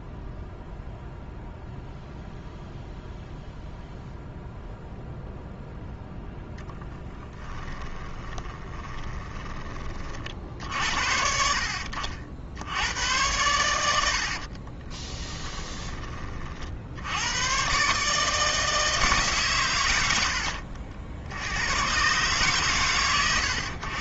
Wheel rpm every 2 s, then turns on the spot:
0, 0, 0, 10, 30, 60, 90, 20, 70, 160, 60, 120.
6-10 14-16